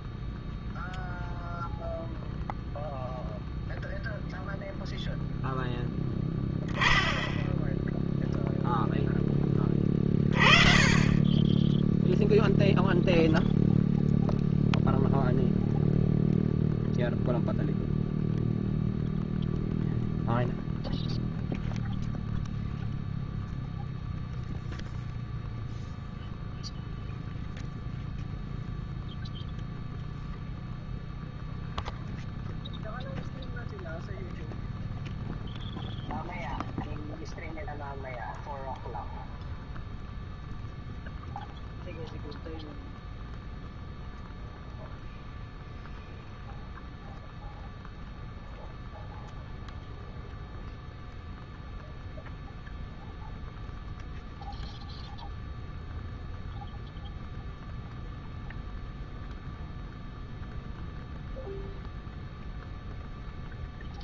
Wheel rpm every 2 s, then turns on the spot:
0, 0, 0, 10, 0, 40, 0, 0, 0, 0, 0, 0, 0, 0, 0, 0, 0, 0, 0, 0, 0, 0, 0, 0, 0, 0, 0, 0, 0, 0, 0, 0.
none